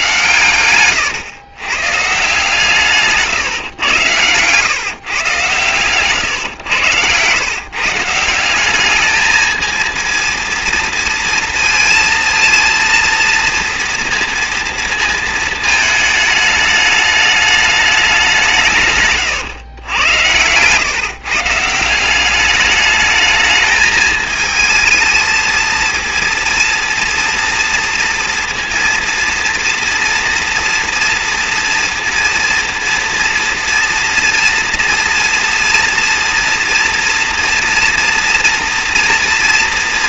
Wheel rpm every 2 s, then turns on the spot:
120, 150, 120, 130, 170, 230, 230, 230, 210, 190, 110, 190, 220, 230, 230, 230, 230, 230, 230, 230.
none